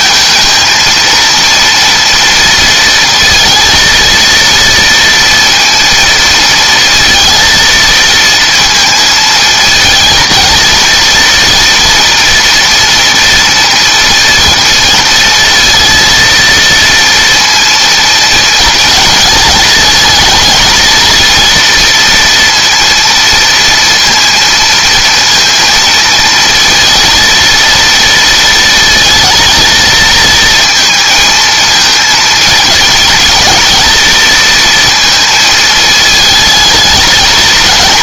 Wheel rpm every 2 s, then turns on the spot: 230, 230, 230, 230, 230, 230, 230, 230, 230, 230, 230, 230, 230, 230, 230, 220, 220, 230, 210.
none